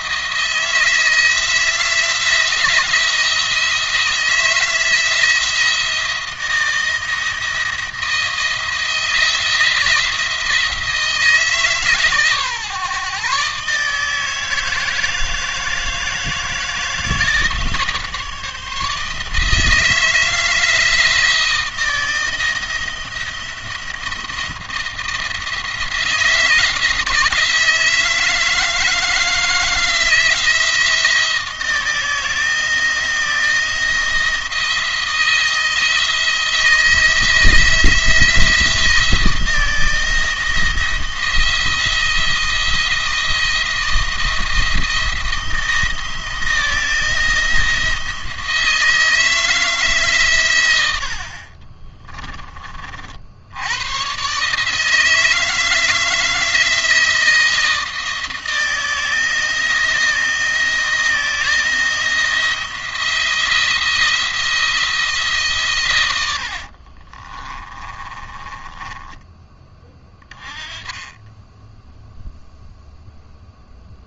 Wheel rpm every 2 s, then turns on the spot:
170, 170, 160, 170, 170, 160, 140, 160, 160, 160, 160, 170, 170, 160, 160, 160, 170, 170, 170, 170, 170, 170, 160, 170, 160, 80, 50, 160, 160, 160, 170, 170, 160, 50, 20, 20, 0.
66-70